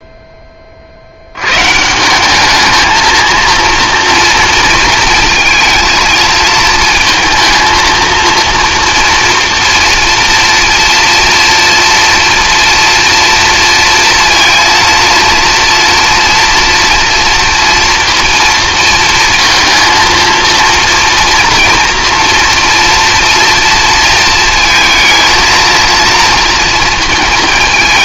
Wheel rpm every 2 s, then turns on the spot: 60, 220, 230, 230, 240, 230, 230, 230, 230, 230, 230, 230, 230, 230.
none